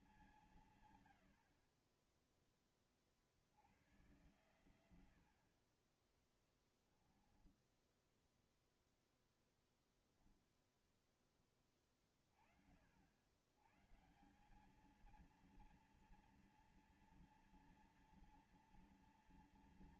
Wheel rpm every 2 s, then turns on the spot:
150, 20, 110, 20, 10, 0, 50, 180, 230, 230.
none